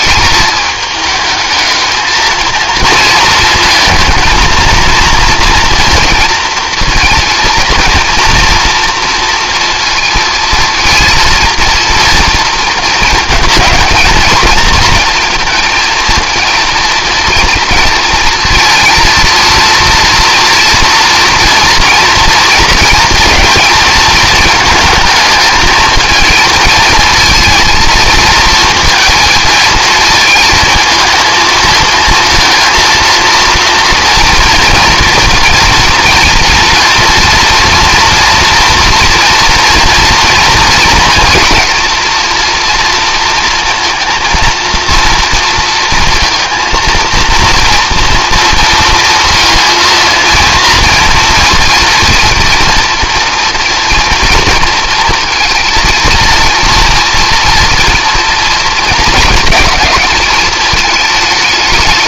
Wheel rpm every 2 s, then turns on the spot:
220, 230, 230, 230, 230, 230, 230, 220, 230, 230, 230, 230, 220, 220, 230, 220, 230, 230, 240, 230, 230, 230, 230, 230, 230, 230, 230, 230, 230, 230, 220.
none